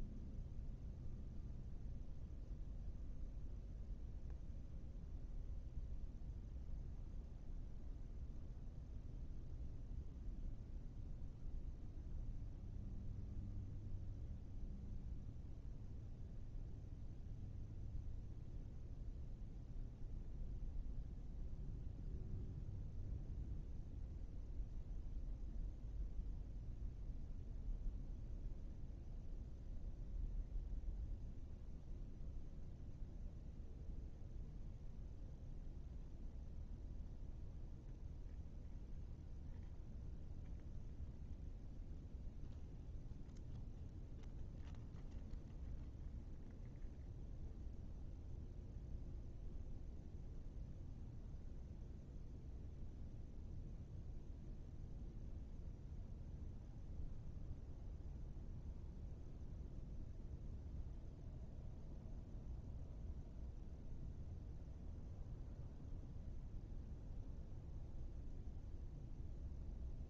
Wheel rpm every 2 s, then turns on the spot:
0, 0, 0, 0, 0, 0, 0, 0, 0, 0, 0, 0, 0, 0, 0, 0, 0, 0, 0, 0, 0, 0, 0, 0, 0, 0, 0, 0, 0, 0, 0, 0, 0, 0, 0.
none